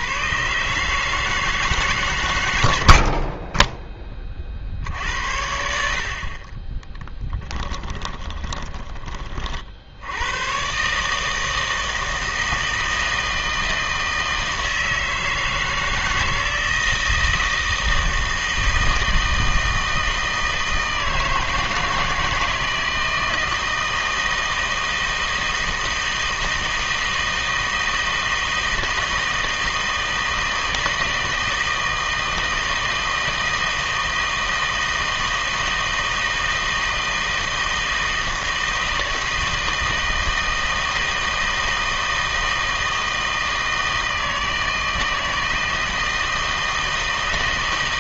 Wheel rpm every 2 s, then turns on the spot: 130, 90, 50, 30, 20, 130, 160, 160, 160, 160, 160, 160, 160, 160, 160, 160, 160, 160, 160, 160, 160, 160, 160, 160.
6-10